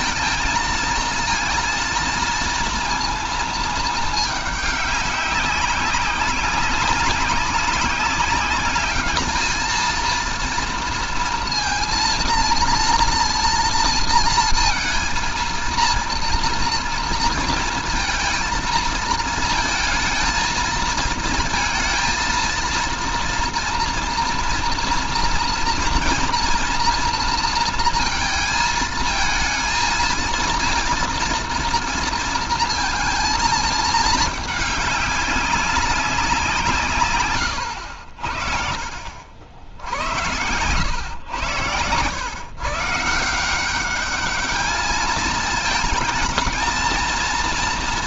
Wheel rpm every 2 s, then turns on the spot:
230, 230, 210, 200, 200, 230, 230, 230, 230, 220, 230, 230, 230, 230, 230, 230, 230, 210, 150, 60, 110, 130, 210, 230.
none